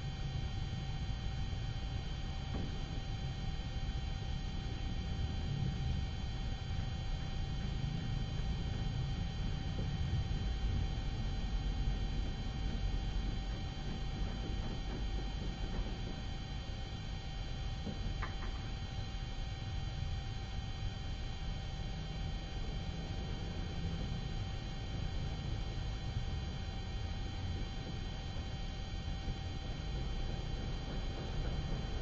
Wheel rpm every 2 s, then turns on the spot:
0, 0, 0, 0, 0, 0, 0, 0, 0, 0, 0, 0, 0, 0, 0, 0.
none